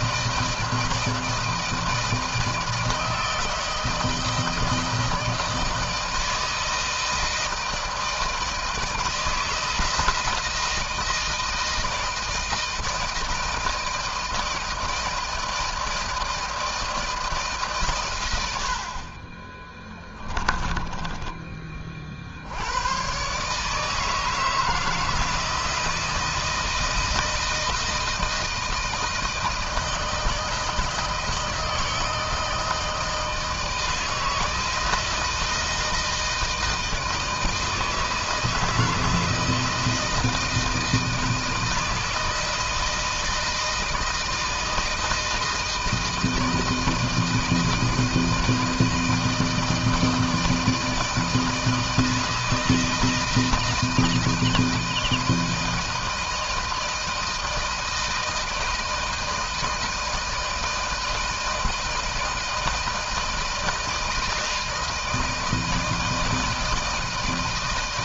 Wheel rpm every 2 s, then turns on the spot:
160, 160, 160, 160, 160, 160, 160, 160, 160, 50, 20, 120, 160, 160, 160, 160, 160, 160, 160, 160, 160, 160, 160, 160, 160, 160, 160, 160, 160, 160, 160, 160, 160, 160.
20-22